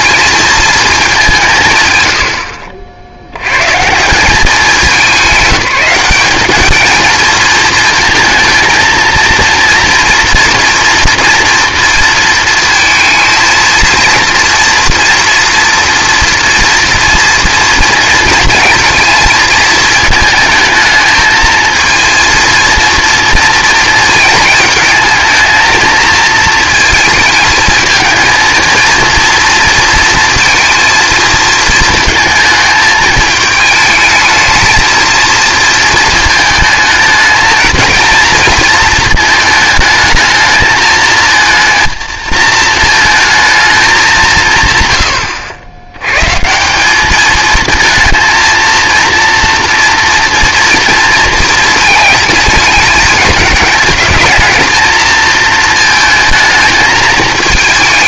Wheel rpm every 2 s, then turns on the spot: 230, 60, 200, 210, 230, 230, 230, 230, 230, 220, 220, 230, 220, 220, 230, 230, 220, 220, 220, 230, 220, 220, 140, 180, 230, 230, 210, 220, 220.
none